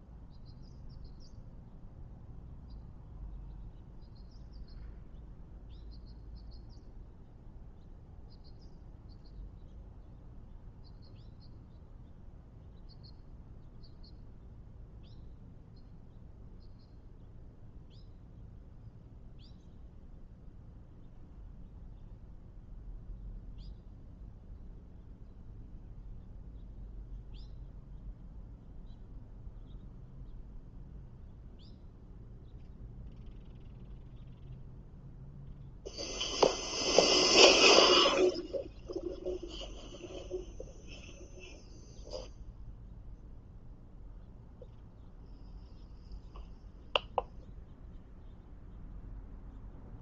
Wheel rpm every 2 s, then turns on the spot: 0, 0, 0, 0, 0, 0, 0, 0, 0, 0, 0, 0, 0, 0, 0, 0, 0, 0, 0, 0, 0, 0, 0, 0, 0.
none